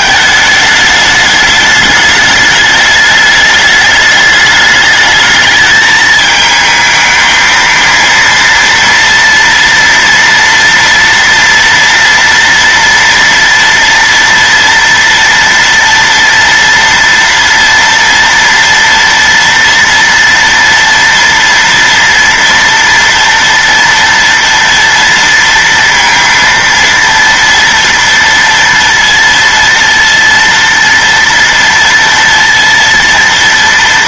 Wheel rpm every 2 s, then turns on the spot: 220, 210, 210, 220, 230, 230, 230, 230, 230, 230, 230, 230, 230, 230, 230, 230, 230.
none